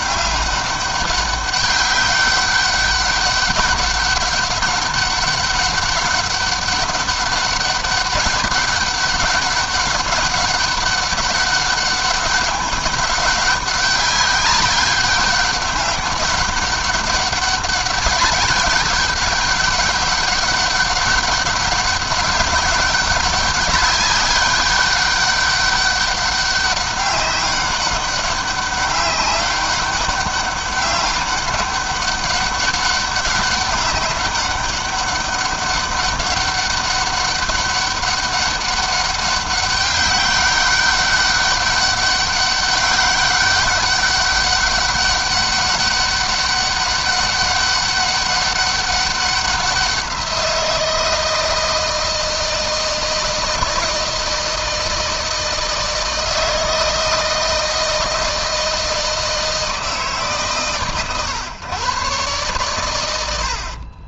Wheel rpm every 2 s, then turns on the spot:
200, 200, 200, 200, 200, 200, 200, 200, 200, 200, 200, 190, 200, 200, 200, 200, 200, 200, 200, 200, 200, 200, 200, 200, 200, 170, 160, 160, 160, 160, 130, 100.
none